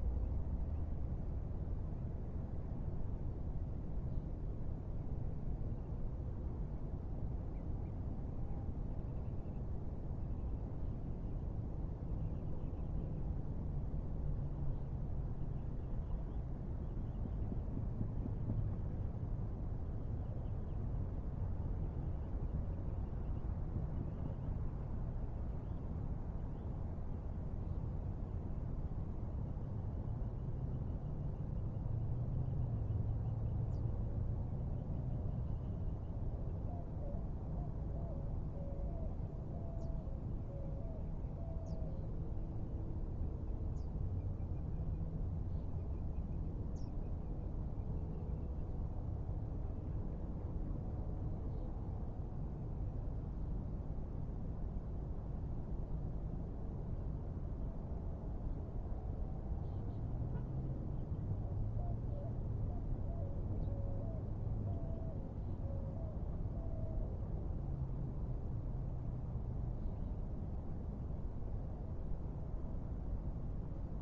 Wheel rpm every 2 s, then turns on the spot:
0, 0, 0, 0, 0, 0, 0, 0, 0, 0, 0, 0, 0, 0, 0, 0, 0, 0, 0, 0, 0, 0, 0, 0, 0, 0, 0, 0, 0, 0, 0, 0, 0, 0, 0, 0, 0.
none